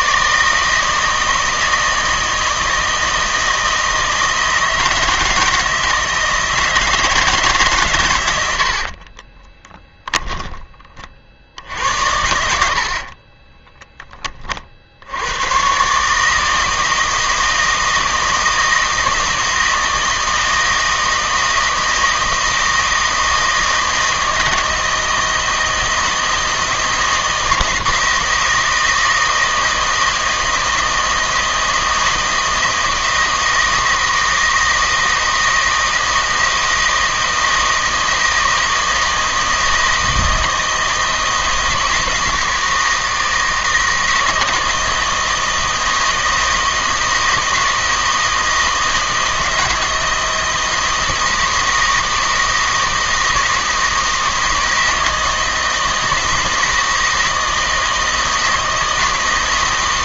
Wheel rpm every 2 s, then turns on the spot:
160, 160, 160, 160, 80, 20, 80, 50, 160, 160, 160, 160, 160, 160, 160, 160, 160, 160, 160, 160, 160, 160, 160, 160, 160, 160, 160, 160, 160, 160.
8-10 12-14